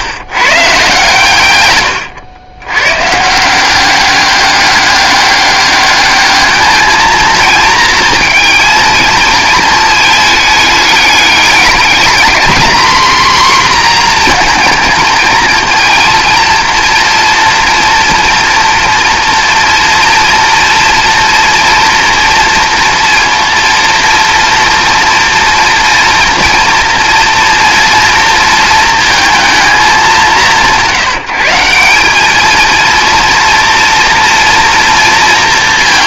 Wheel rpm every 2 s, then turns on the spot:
130, 120, 200, 220, 230, 210, 240, 230, 240, 240, 230, 230, 230, 230, 230, 180, 230, 230.
none